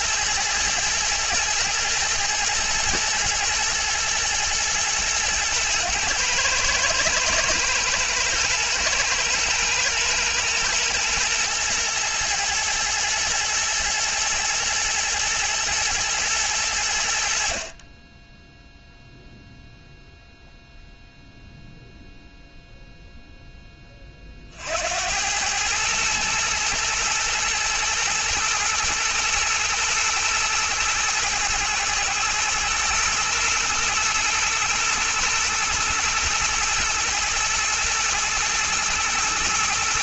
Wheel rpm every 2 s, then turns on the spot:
120, 120, 120, 110, 110, 120, 110, 120, 80, 0, 0, 0, 90, 110, 120, 110, 120, 120, 120, 110.
none